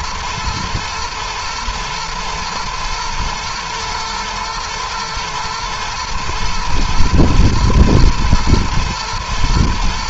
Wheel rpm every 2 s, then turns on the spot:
110, 110, 120, 110, 110.
none